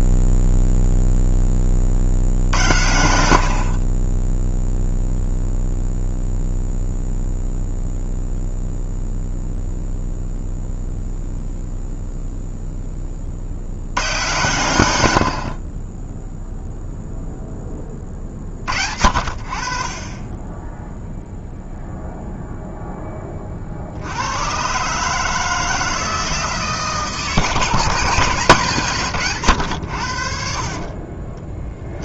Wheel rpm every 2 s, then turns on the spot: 0, 70, 0, 0, 0, 0, 10, 100, 0, 50, 10, 0, 130, 160, 150, 40.
none